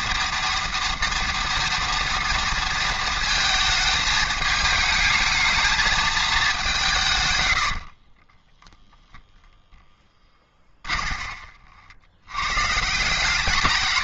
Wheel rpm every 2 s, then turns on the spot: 230, 230, 220, 190, 10, 20, 140.
8-12